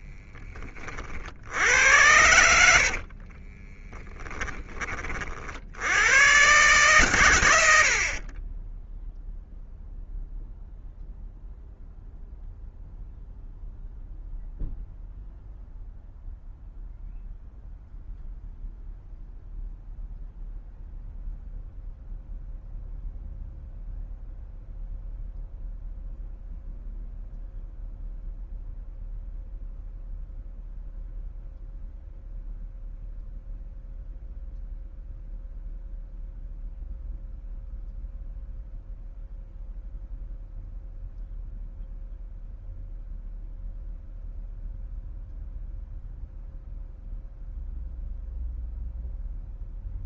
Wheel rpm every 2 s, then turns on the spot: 50, 40, 40, 120, 0, 0, 0, 0, 0, 0, 0, 0, 0, 0, 0, 0, 0, 0, 0, 0, 0, 0, 0, 0, 0.
2-4